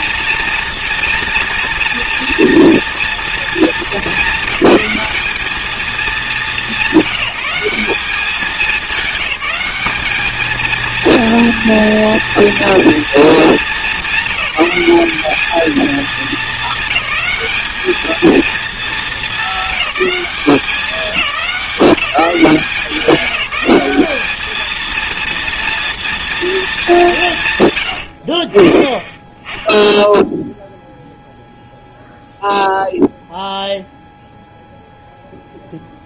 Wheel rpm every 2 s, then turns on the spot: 230, 230, 220, 200, 200, 220, 230, 190, 210, 220, 190, 180, 220, 220, 30, 0, 0, 0.
none